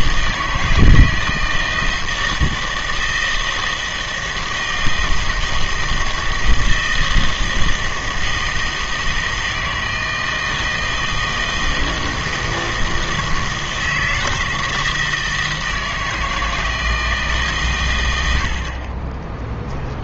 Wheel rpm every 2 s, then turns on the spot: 160, 160, 160, 160, 160, 160, 160, 160, 160, 60.
none